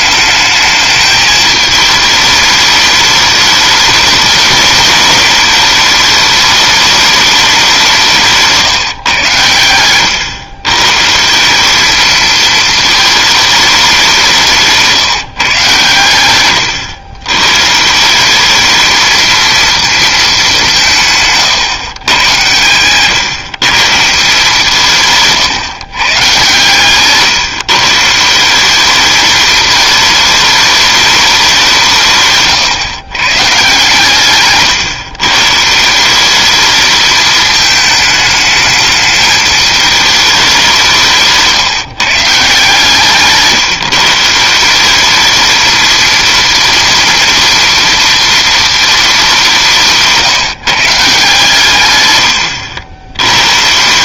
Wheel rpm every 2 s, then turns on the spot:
210, 210, 210, 210, 150, 120, 220, 160, 110, 210, 180, 110, 160, 130, 190, 210, 130, 120, 210, 220, 180, 150, 180, 230, 230, 150, 90.
none